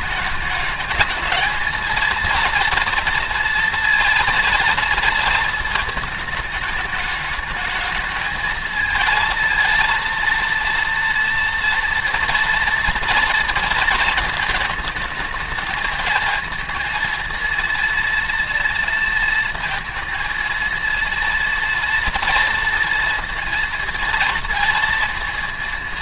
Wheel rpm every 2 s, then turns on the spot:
210, 230, 230, 210, 220, 230, 230, 230, 220, 230, 230, 230, 230.
none